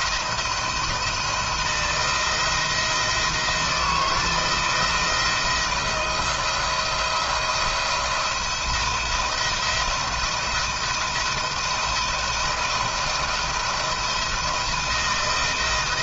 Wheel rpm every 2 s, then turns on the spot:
170, 170, 170, 170, 170, 170, 160, 160.
none